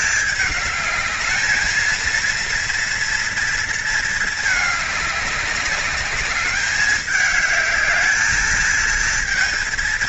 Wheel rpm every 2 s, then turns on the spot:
210, 240, 210, 210, 220.
none